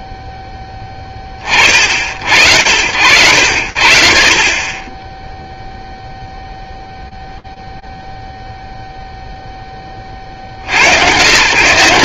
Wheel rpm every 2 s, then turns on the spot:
10, 90, 50, 0, 0, 90.
none